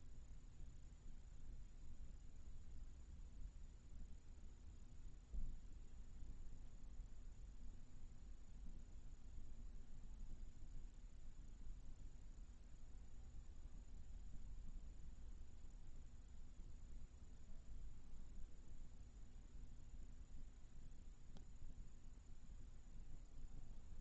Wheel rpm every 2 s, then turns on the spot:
0, 0, 0, 0, 0, 0, 0, 0, 0, 0, 0, 0.
none